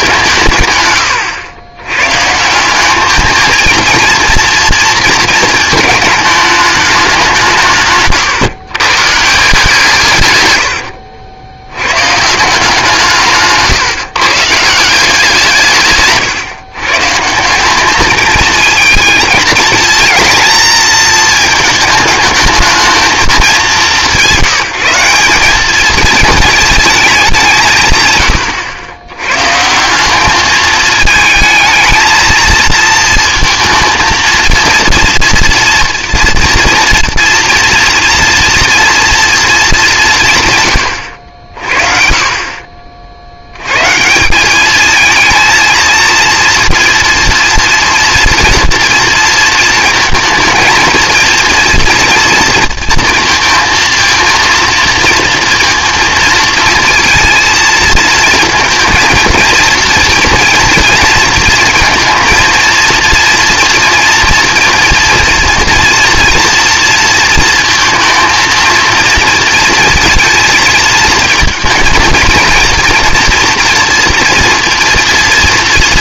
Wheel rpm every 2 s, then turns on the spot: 150, 170, 230, 210, 130, 100, 170, 150, 130, 220, 230, 220, 190, 220, 90, 210, 220, 230, 230, 230, 130, 40, 200, 230, 230, 220, 230, 230, 230, 230, 230, 230, 230, 230, 230, 230, 230, 230.
none